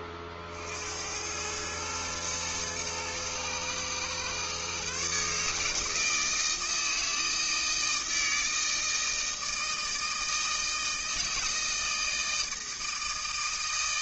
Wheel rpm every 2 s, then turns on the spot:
50, 110, 130, 160, 160, 160, 160.
none